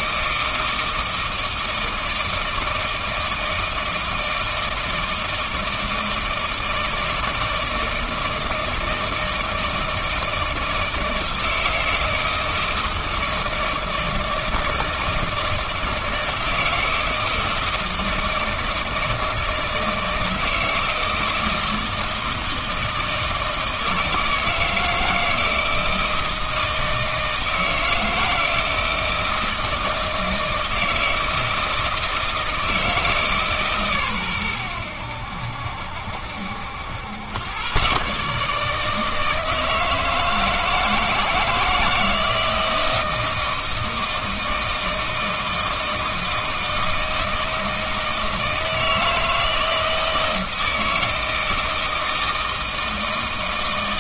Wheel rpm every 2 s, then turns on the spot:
160, 160, 160, 160, 160, 160, 160, 160, 160, 160, 160, 160, 160, 160, 170, 160, 160, 100, 80, 150, 160, 170, 160, 160, 160, 160, 160.
none